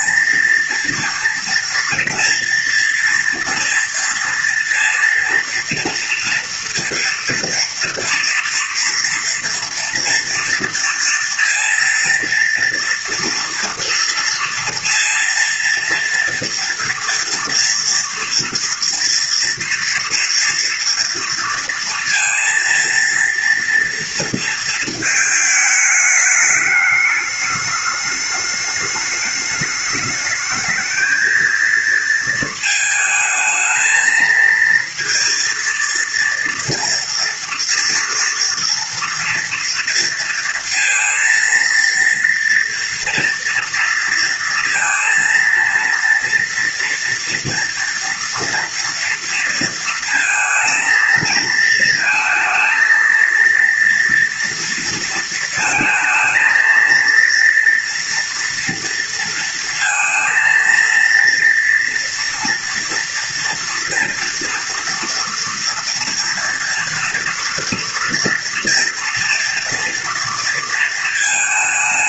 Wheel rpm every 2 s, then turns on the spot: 230, 230, 230, 240, 230, 230, 230, 230, 240, 230, 230, 230, 220, 210, 210, 220, 220, 230, 230, 240, 230, 240, 230, 230, 230, 220, 230, 230, 230, 230, 230, 230, 230, 230, 230, 230.
none